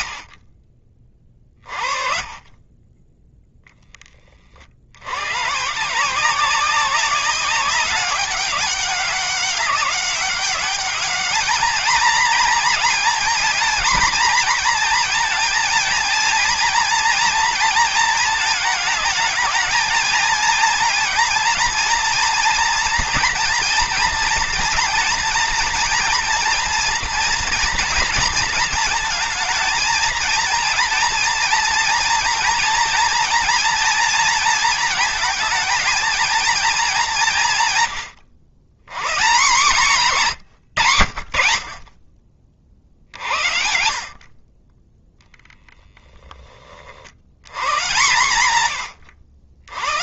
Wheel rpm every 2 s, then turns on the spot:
40, 20, 70, 190, 200, 210, 240, 230, 230, 230, 220, 230, 230, 230, 220, 230, 230, 230, 210, 140, 110, 50, 20, 50, 110.
none